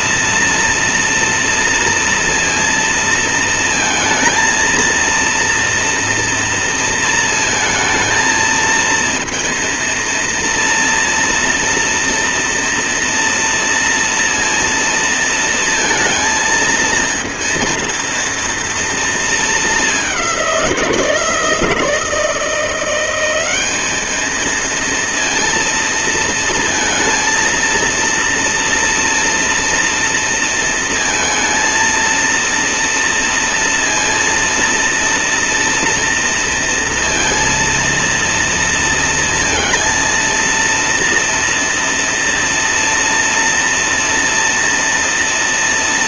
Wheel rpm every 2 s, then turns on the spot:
230, 230, 230, 230, 230, 230, 230, 230, 230, 230, 170, 180, 230, 230, 230, 230, 230, 230, 230, 230, 230, 230, 230.
none